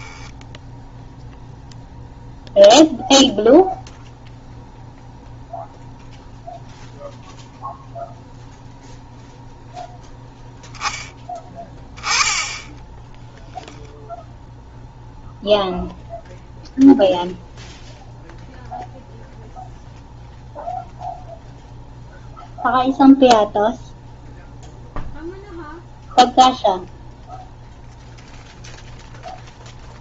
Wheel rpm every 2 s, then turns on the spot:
0, 0, 0, 0, 0, 0, 10, 0, 0, 0, 0, 0, 0, 0, 0.
none